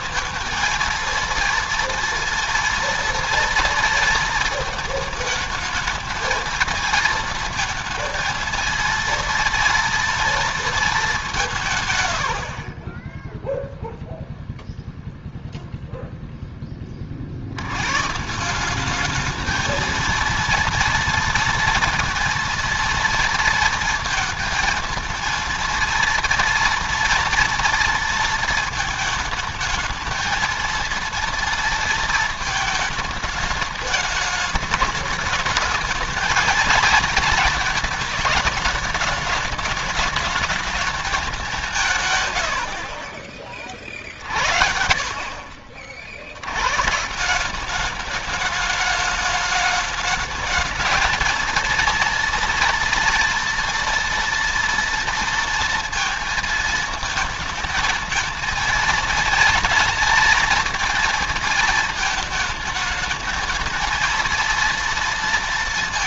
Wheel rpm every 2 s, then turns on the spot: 230, 230, 220, 220, 230, 210, 40, 0, 30, 200, 230, 230, 230, 230, 220, 230, 220, 210, 220, 210, 220, 50, 50, 140, 220, 220, 230, 230, 220, 230, 230, 210, 230.
none